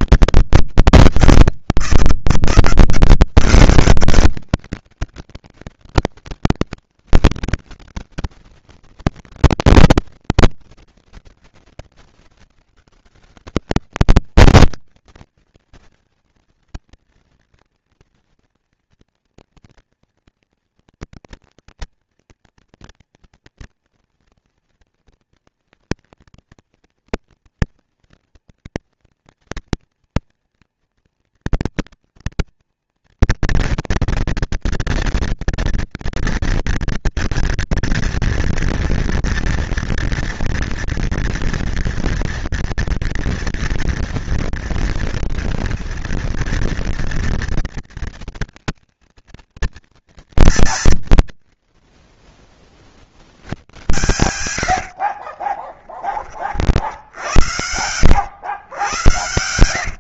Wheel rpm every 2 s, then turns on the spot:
160, 180, 200, 200, 170, 160, 180, 230, 230, 230, 240, 230, 230, 230, 230, 230, 230, 230, 230, 230, 230, 230, 230, 230, 230, 160, 30, 100, 40, 100.
54-56